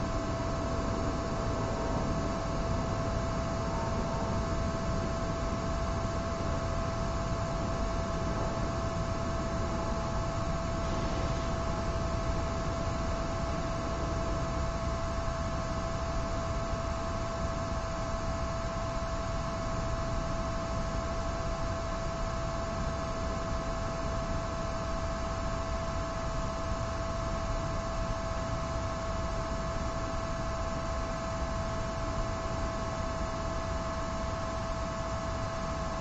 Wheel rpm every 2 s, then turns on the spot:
0, 0, 0, 0, 0, 0, 0, 0, 0, 0, 0, 0, 0, 0, 0, 0, 0, 0.
none